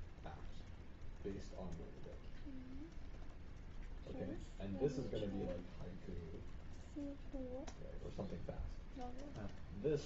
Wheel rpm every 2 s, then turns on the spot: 0, 0, 0, 0, 0.
none